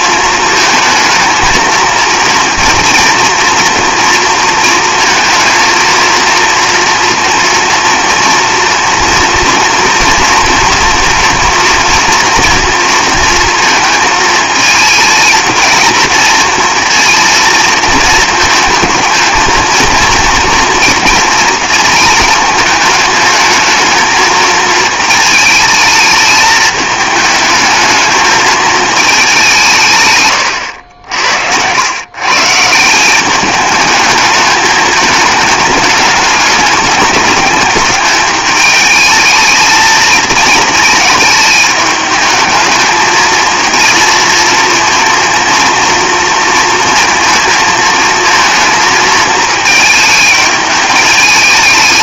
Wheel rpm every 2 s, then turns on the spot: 230, 230, 230, 230, 240, 230, 230, 220, 230, 220, 230, 220, 220, 220, 220, 110, 150, 210, 210, 210, 220, 220, 230, 230, 230, 210.
30-32